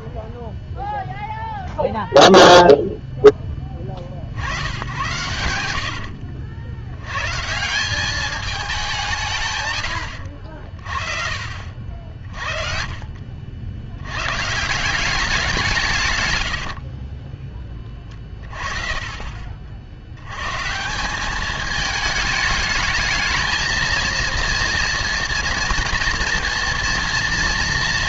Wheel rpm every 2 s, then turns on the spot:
0, 0, 90, 80, 200, 50, 40, 150, 60, 40, 140, 220, 230, 230.
4-6 16-18